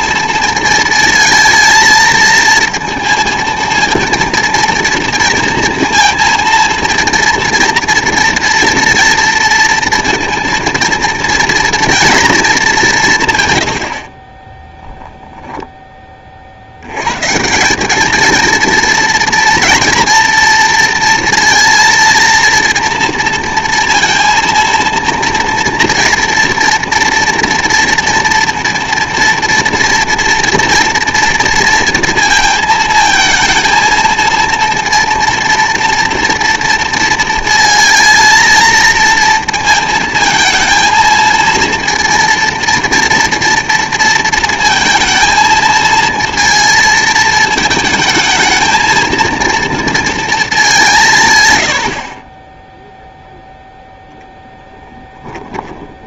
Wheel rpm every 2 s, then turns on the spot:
220, 230, 230, 230, 230, 230, 200, 10, 80, 230, 230, 230, 230, 230, 230, 230, 230, 230, 230, 230, 230, 230, 230, 220, 230, 190, 0, 10.
14-16